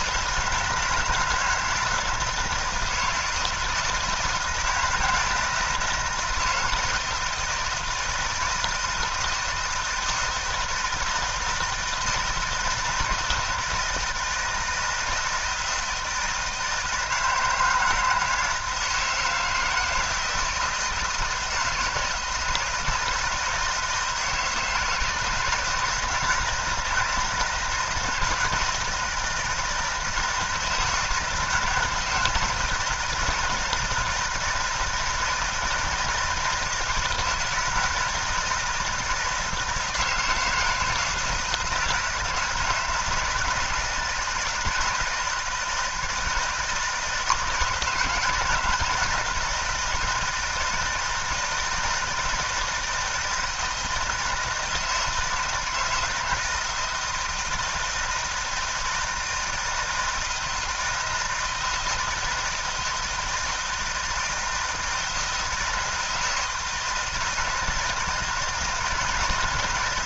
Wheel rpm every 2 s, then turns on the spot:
160, 160, 160, 160, 160, 160, 160, 160, 160, 160, 160, 160, 160, 160, 160, 160, 160, 160, 170, 160, 160, 160, 160, 160, 170, 160, 160, 170, 160, 160, 160, 160, 160, 160, 160.
none